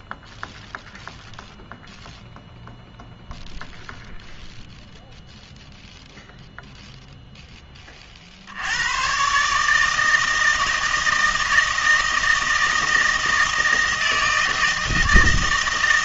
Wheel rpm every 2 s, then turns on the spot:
0, 0, 0, 0, 80, 160, 160, 160.
none